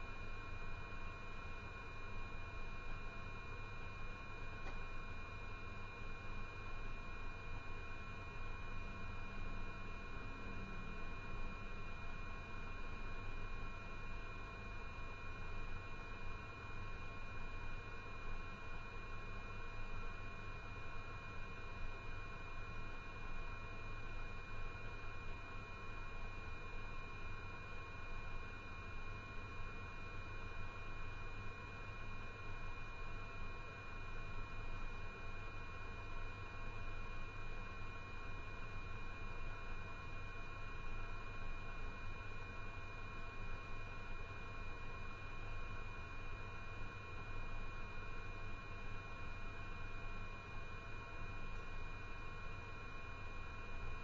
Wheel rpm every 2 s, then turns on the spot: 0, 0, 0, 0, 0, 0, 0, 0, 0, 0, 0, 0, 0, 0, 0, 0, 0, 0, 0, 0, 0, 0, 0, 0, 0, 0, 0.
none